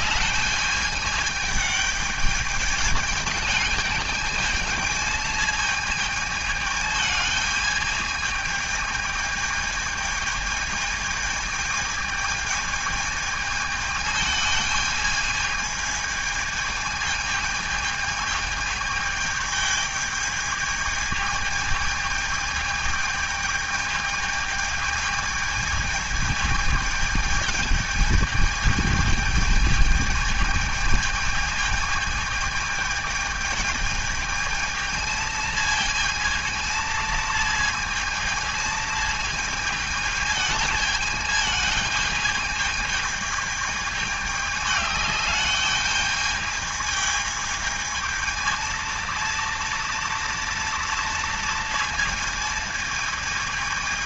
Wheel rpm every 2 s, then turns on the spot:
210, 210, 220, 220, 220, 220, 220, 210, 210, 210, 220, 220, 220, 210, 220, 220, 210, 220, 230, 220, 220, 210, 210, 220, 220, 230, 220.
none